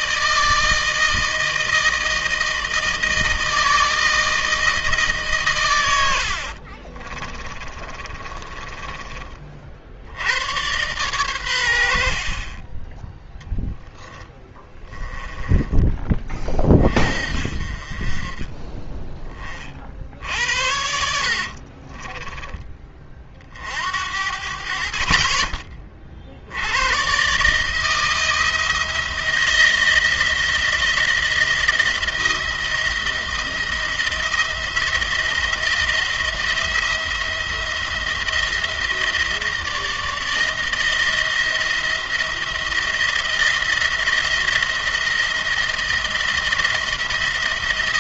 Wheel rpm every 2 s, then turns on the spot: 160, 160, 160, 50, 20, 110, 30, 10, 30, 20, 60, 20, 60, 90, 160, 170, 160, 170, 170, 160, 160, 170, 170, 170.
6-10 14-16 20-22